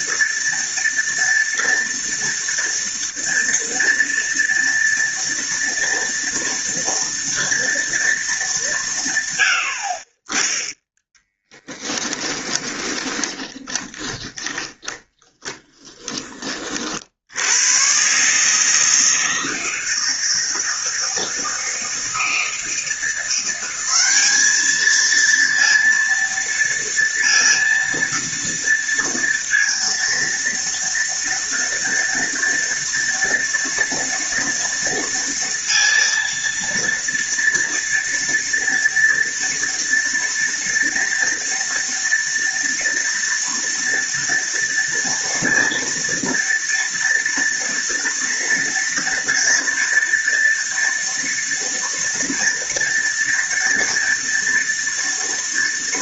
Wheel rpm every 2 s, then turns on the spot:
230, 230, 230, 230, 170, 10, 20, 30, 50, 160, 160, 170, 220, 230, 230, 230, 230, 230, 230, 230, 230, 230, 230, 230, 230, 240, 240, 230.
12-16